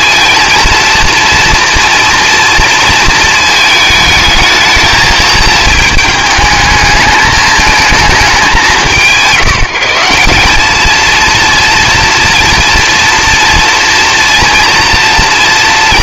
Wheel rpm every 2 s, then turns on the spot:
230, 230, 220, 220, 180, 200, 230, 230.
none